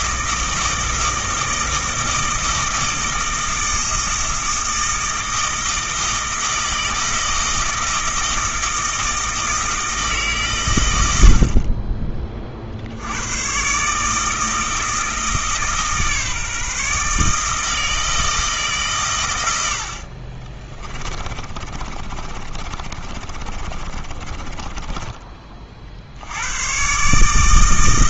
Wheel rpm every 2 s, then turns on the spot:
160, 160, 160, 160, 160, 110, 60, 160, 150, 130, 30, 40, 20, 120.
20-26